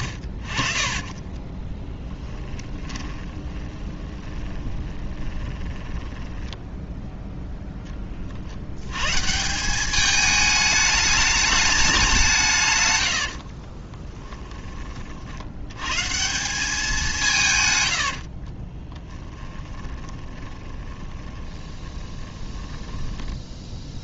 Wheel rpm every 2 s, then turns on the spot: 60, 20, 20, 10, 80, 210, 130, 20, 190, 30, 20, 20.
2-6 18-24